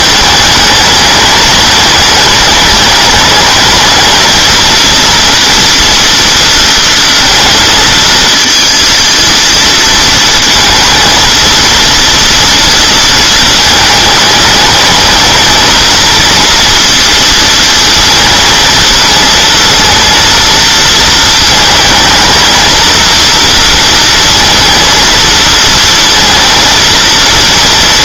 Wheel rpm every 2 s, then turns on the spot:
210, 210, 230, 230, 230, 230, 230, 220, 230, 230, 230, 230, 230, 230.
none